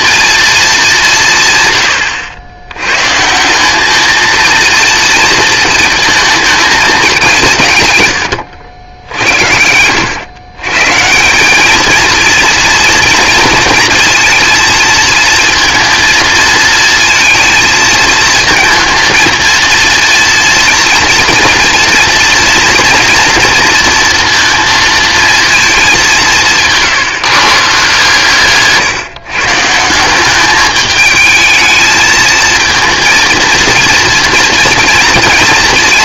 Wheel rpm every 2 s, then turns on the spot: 210, 100, 230, 210, 80, 140, 230, 230, 230, 230, 230, 240, 230, 150, 140, 210, 230, 230.
28-30